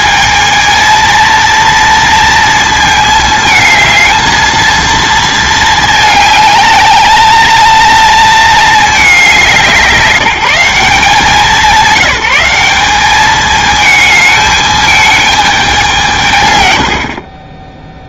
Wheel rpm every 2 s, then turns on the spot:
230, 230, 230, 210, 210, 180, 200, 210, 110.
none